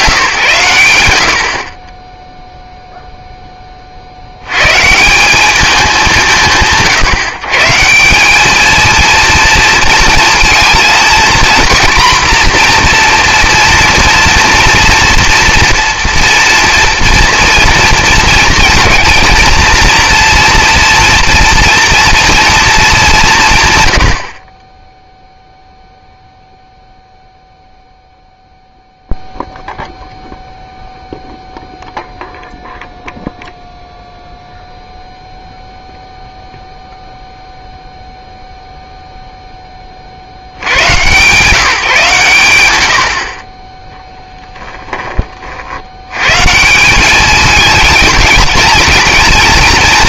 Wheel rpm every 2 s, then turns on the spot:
140, 0, 110, 160, 220, 230, 240, 230, 230, 230, 240, 230, 20, 0, 0, 0, 0, 0, 0, 0, 110, 110, 10, 160, 220.
none